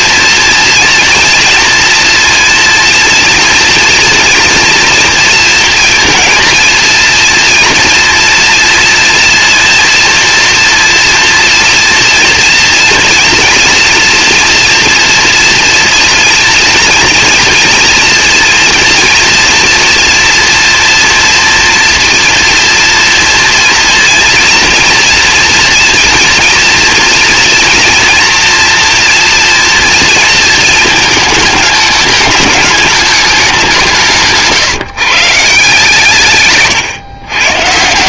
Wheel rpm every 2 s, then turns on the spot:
230, 230, 230, 230, 230, 230, 240, 230, 230, 230, 240, 230, 230, 240, 230, 220, 210, 170, 130.
none